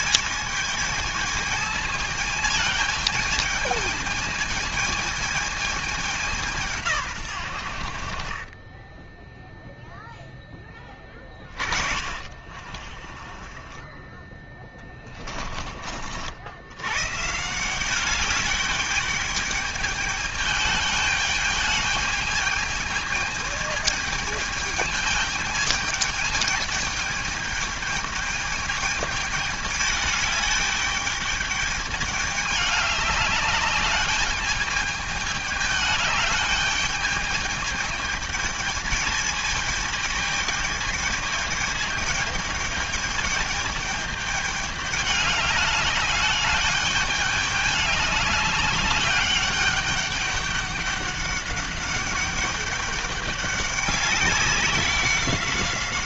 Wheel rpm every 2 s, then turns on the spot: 220, 220, 220, 150, 10, 10, 30, 20, 130, 210, 210, 210, 210, 210, 210, 210, 210, 210, 210, 220, 210, 210, 210, 210, 200, 200, 200, 190.
8-10 12-16